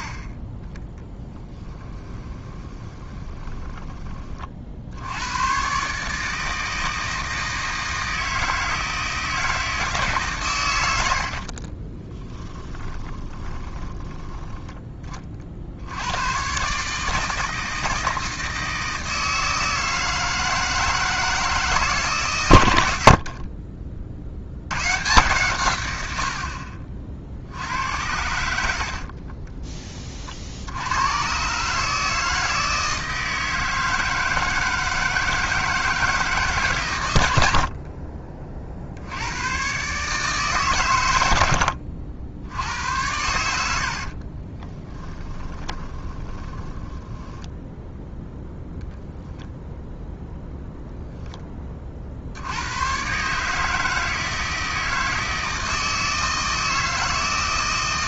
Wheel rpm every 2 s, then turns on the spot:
30, 20, 60, 160, 160, 100, 10, 20, 140, 160, 160, 90, 110, 50, 70, 90, 160, 160, 130, 60, 130, 80, 20, 10, 10, 0, 110, 160, 160.
2-4 12-14 22-24 44-50